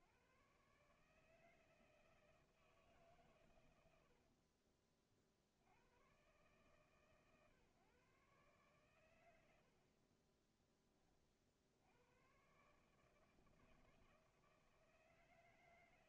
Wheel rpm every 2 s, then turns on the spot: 150, 160, 40, 140, 130, 20, 150, 160.
4-6